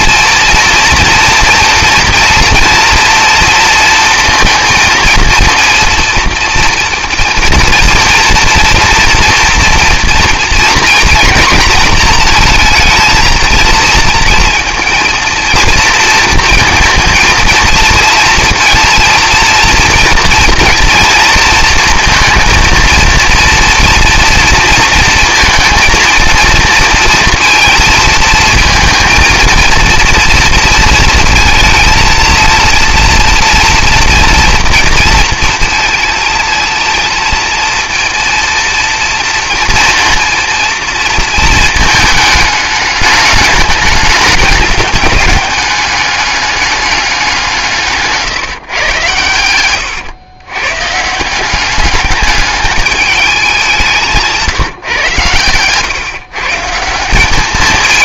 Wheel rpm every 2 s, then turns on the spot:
240, 230, 230, 230, 240, 240, 230, 230, 230, 230, 230, 230, 230, 230, 220, 230, 230, 230, 230, 230, 230, 210, 200, 210, 130, 130, 210, 150, 150.
none